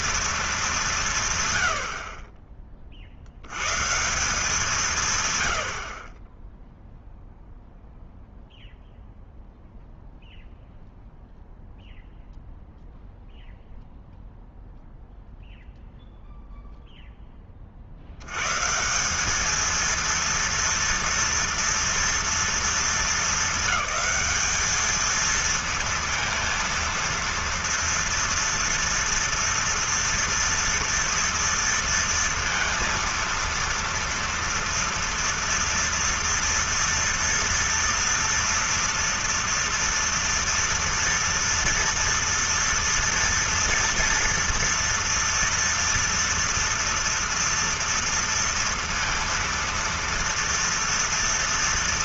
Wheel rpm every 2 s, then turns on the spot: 210, 30, 170, 10, 0, 0, 0, 0, 0, 140, 230, 230, 220, 230, 230, 240, 230, 230, 230, 230, 230, 230, 230, 230, 230, 230.
none